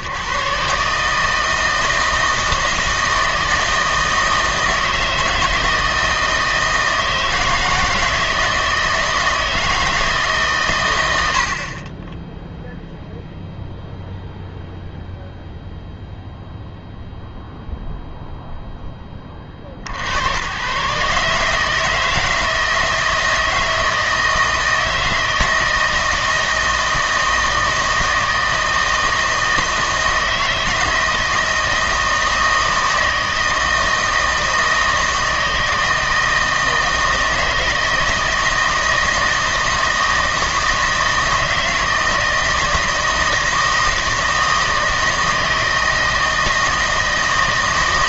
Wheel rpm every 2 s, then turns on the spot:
140, 160, 160, 160, 160, 130, 0, 0, 0, 0, 110, 160, 160, 160, 160, 160, 160, 160, 160, 160, 160, 160, 160, 160.
none